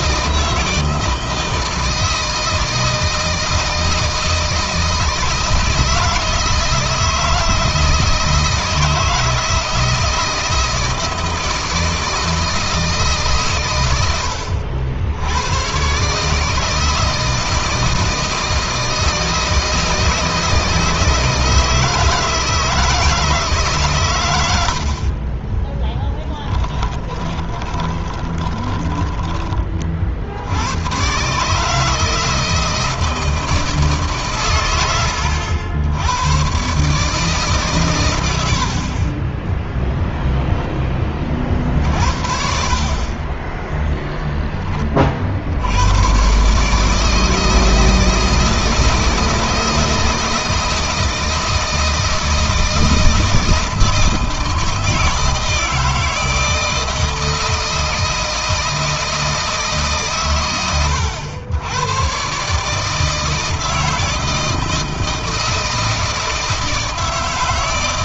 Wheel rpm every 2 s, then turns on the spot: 160, 160, 160, 160, 160, 160, 150, 90, 160, 160, 160, 160, 40, 20, 20, 110, 160, 100, 150, 40, 20, 40, 40, 160, 160, 160, 160, 160, 160, 160, 90, 160, 160, 160.
26-30 38-40